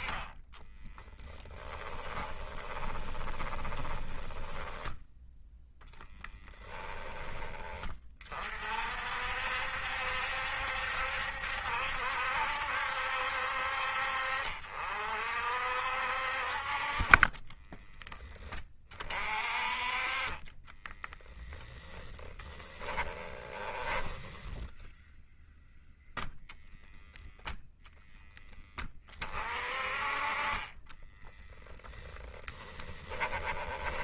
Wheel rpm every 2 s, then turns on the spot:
20, 20, 10, 10, 50, 70, 70, 50, 40, 30, 10, 10, 0, 0, 20, 20, 10.
0-6 16-18 20-24 30-34